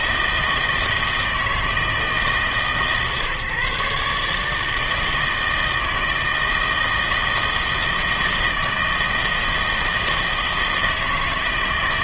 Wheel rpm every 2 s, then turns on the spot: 160, 150, 150, 160, 160, 160.
none